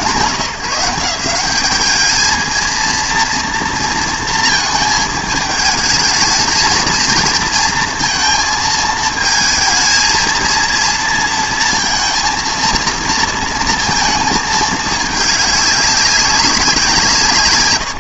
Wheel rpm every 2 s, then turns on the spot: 170, 230, 220, 230, 220, 230, 230, 220, 200.
none